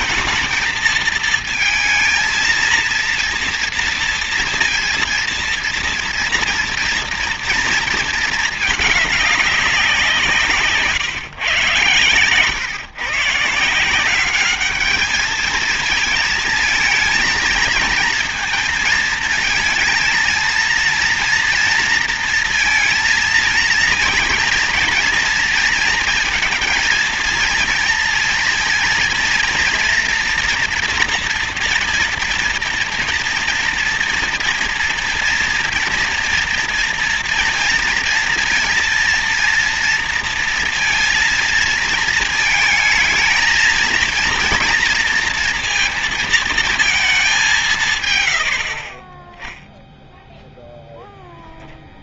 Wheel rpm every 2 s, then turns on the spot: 220, 230, 230, 240, 210, 140, 120, 210, 230, 230, 230, 230, 230, 230, 230, 230, 230, 230, 230, 230, 230, 220, 230, 220, 40, 0.
none